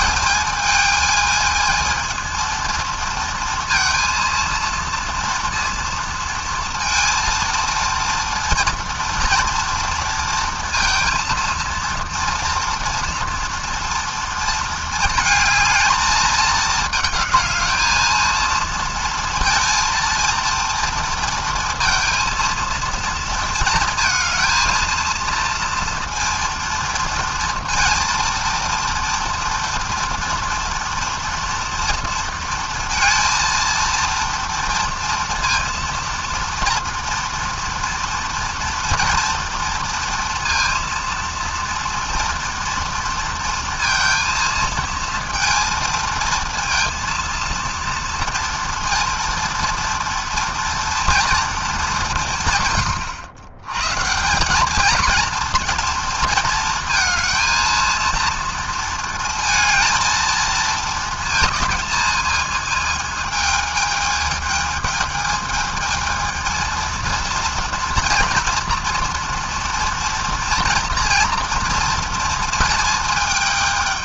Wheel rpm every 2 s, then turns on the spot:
220, 230, 230, 230, 230, 230, 230, 220, 220, 230, 230, 230, 230, 230, 230, 240, 230, 230, 230, 230, 230, 230, 220, 230, 240, 230, 110, 230, 230, 230, 220, 220, 220, 230, 230, 240, 220.
none